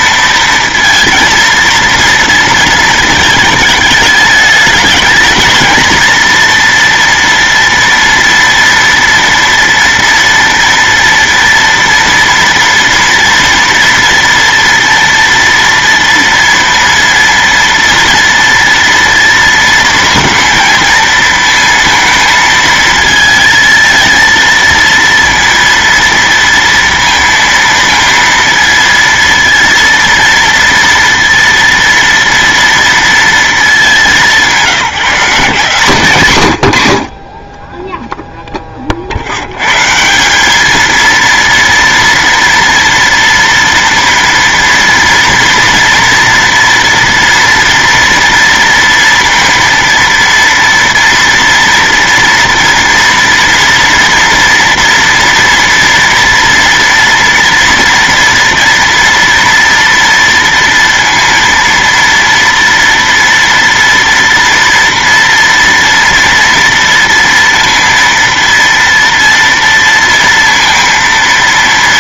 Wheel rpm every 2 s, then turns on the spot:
230, 230, 210, 230, 230, 230, 230, 230, 230, 230, 230, 230, 230, 230, 230, 230, 230, 180, 70, 30, 220, 230, 230, 230, 230, 230, 230, 230, 230, 230, 230, 230, 230, 230, 230, 230.
none